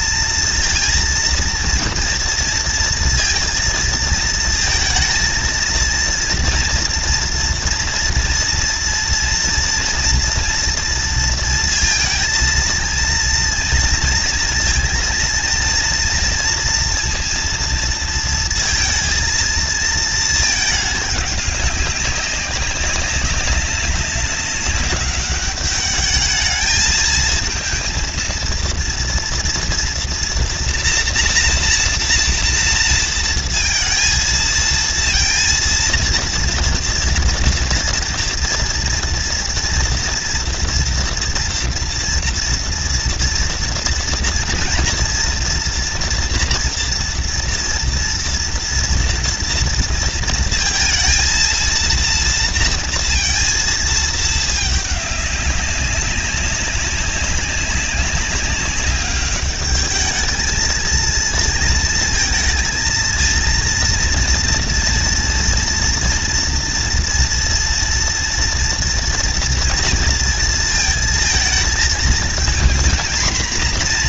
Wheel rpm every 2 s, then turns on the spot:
230, 230, 230, 230, 230, 240, 230, 230, 230, 230, 220, 190, 200, 210, 230, 240, 230, 230, 230, 230, 230, 230, 230, 240, 230, 230, 230, 220, 190, 200, 220, 220, 230, 230, 230, 230, 220.
none